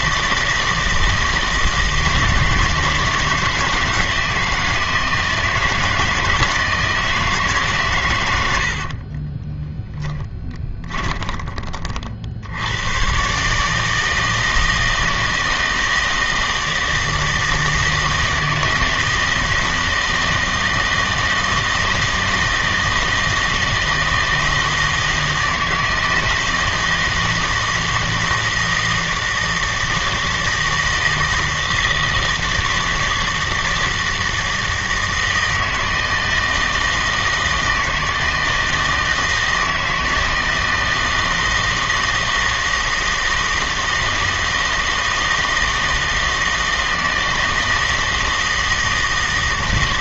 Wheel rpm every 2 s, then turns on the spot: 160, 160, 160, 160, 60, 20, 100, 160, 160, 160, 160, 160, 160, 160, 160, 160, 160, 160, 160, 160, 160, 160, 160, 160, 160.
8-12